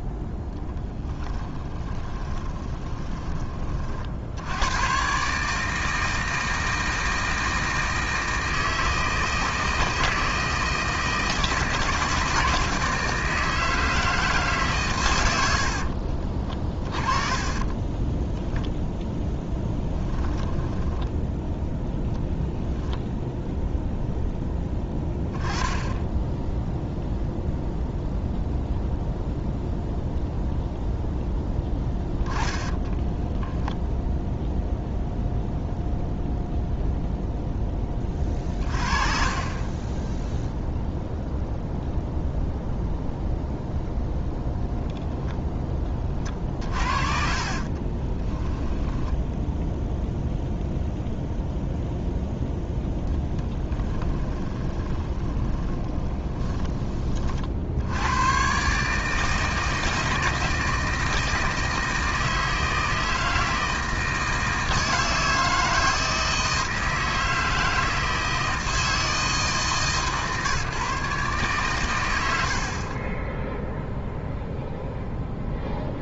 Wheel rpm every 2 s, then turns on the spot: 0, 20, 110, 160, 160, 160, 160, 140, 30, 0, 10, 0, 10, 0, 0, 0, 10, 0, 0, 30, 0, 0, 0, 30, 10, 0, 0, 20, 20, 140, 160, 160, 160, 160, 160, 150, 80, 0.
2-4 20-22 32-34 46-50 54-56